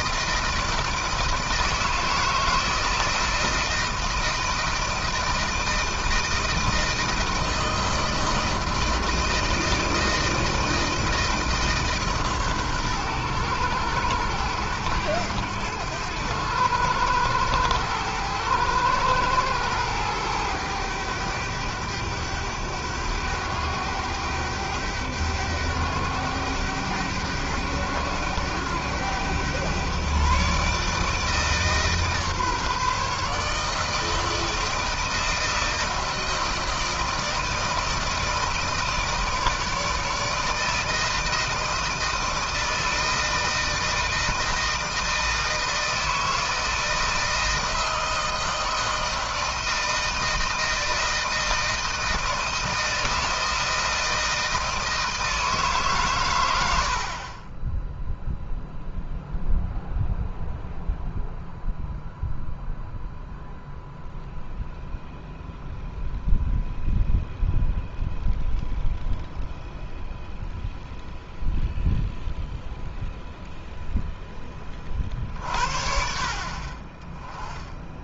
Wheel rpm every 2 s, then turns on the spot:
160, 160, 160, 160, 160, 160, 130, 100, 100, 110, 110, 100, 100, 100, 100, 140, 150, 160, 160, 160, 160, 160, 160, 160, 160, 160, 160, 160, 100, 0, 0, 0, 0, 0, 0, 0, 0, 20, 40.
none